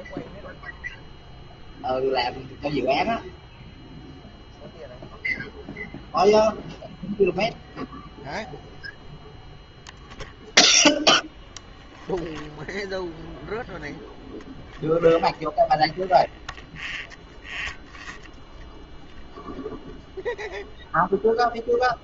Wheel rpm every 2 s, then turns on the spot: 0, 0, 0, 0, 0, 0, 0, 0, 0, 0, 0.
none